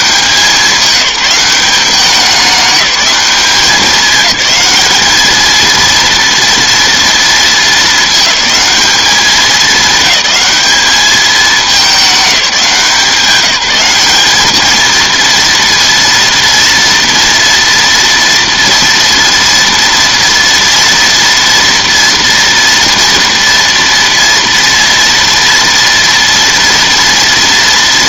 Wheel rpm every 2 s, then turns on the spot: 190, 200, 210, 230, 210, 200, 180, 220, 230, 230, 230, 230, 230, 230.
none